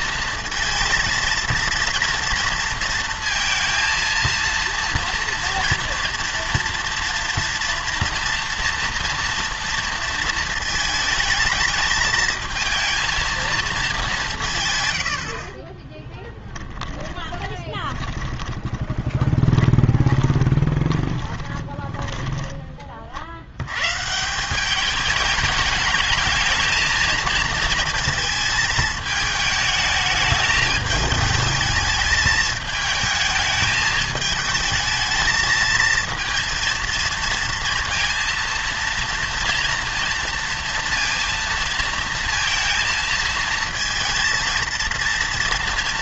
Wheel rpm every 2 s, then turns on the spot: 230, 230, 230, 230, 230, 220, 220, 140, 10, 20, 20, 20, 190, 220, 220, 210, 220, 220, 230, 230, 230, 230, 230.
16-22